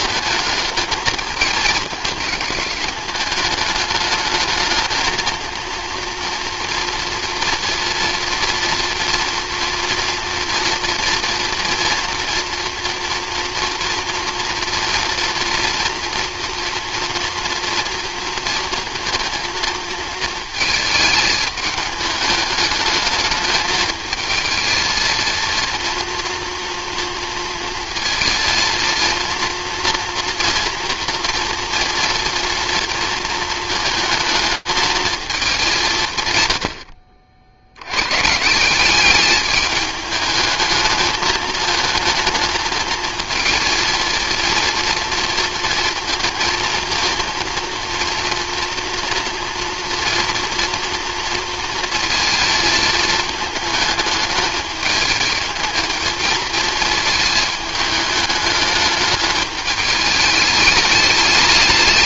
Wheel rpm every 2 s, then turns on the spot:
220, 210, 220, 230, 230, 230, 230, 230, 240, 230, 220, 210, 220, 230, 230, 240, 230, 220, 80, 180, 210, 220, 230, 230, 230, 240, 220, 210, 220, 210, 210.
none